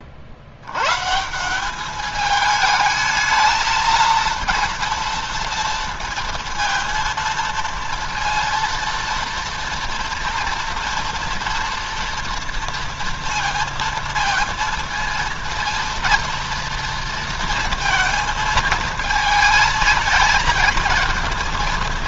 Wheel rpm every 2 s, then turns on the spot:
120, 220, 230, 230, 230, 230, 230, 230, 230, 220, 220.
none